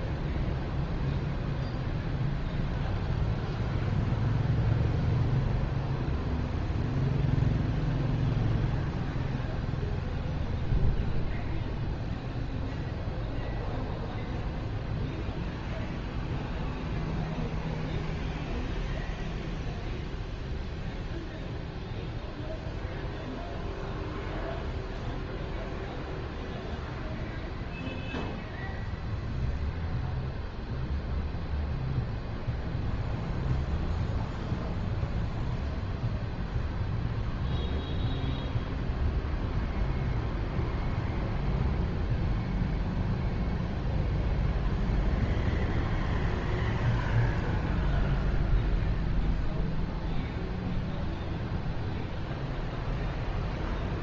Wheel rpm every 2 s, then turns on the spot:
0, 0, 0, 0, 0, 0, 0, 0, 0, 0, 0, 0, 0, 0, 0, 0, 0, 0, 0, 0, 0, 0, 0, 0, 0, 0, 0.
none